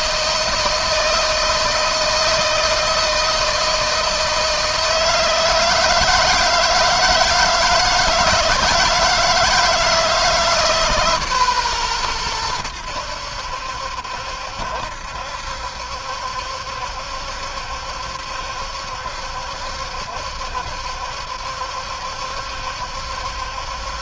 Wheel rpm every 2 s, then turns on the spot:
160, 160, 160, 160, 160, 150, 90, 70, 70, 70, 70, 70.
none